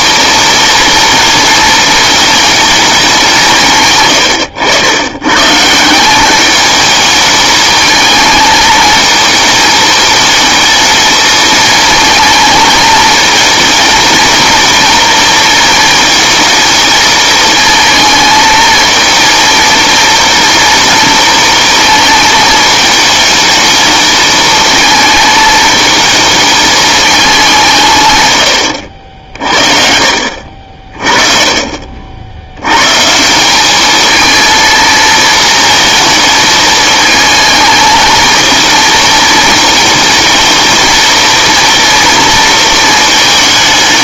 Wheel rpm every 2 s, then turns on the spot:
230, 200, 110, 210, 220, 220, 220, 230, 220, 230, 230, 220, 220, 210, 60, 40, 120, 230, 220, 230, 230, 220.
none